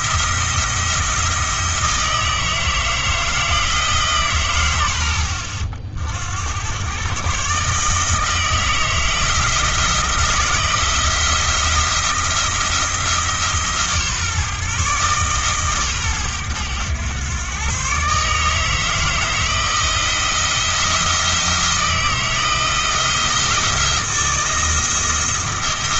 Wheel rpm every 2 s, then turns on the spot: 170, 160, 90, 100, 160, 170, 170, 140, 110, 160, 160, 160, 160.
none